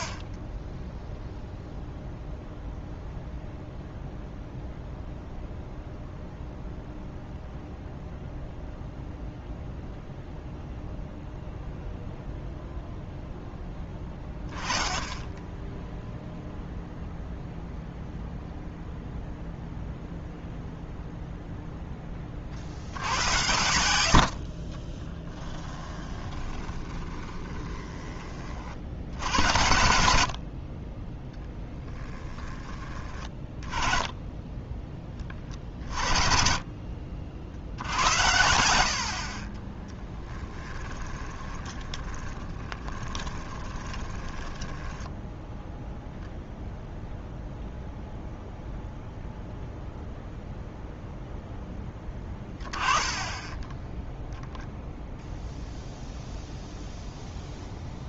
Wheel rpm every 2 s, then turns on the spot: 0, 0, 0, 0, 0, 0, 0, 10, 0, 0, 0, 60, 30, 20, 70, 30, 20, 20, 50, 60, 20, 20, 10, 0, 0, 0, 20, 0, 0.
24-28 40-46 52-54